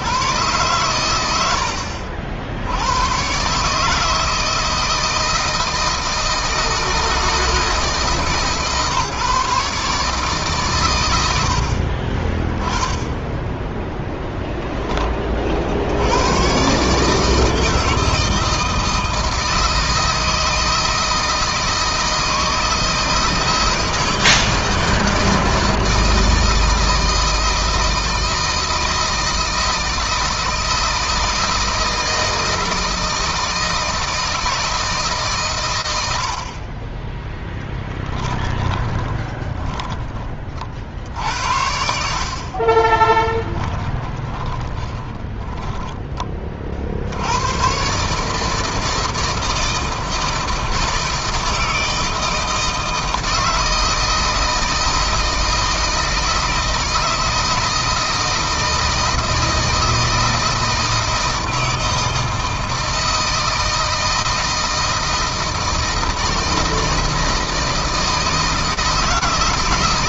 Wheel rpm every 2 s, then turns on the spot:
110, 100, 160, 160, 140, 120, 10, 20, 140, 160, 160, 160, 160, 160, 160, 160, 160, 160, 30, 10, 50, 30, 20, 60, 160, 160, 160, 160, 160, 160, 160, 160, 160, 160, 160.
38-40 42-46